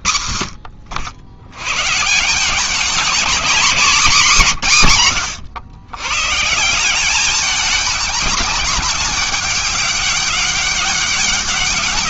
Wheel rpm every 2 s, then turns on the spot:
60, 200, 170, 170, 200, 200.
0-2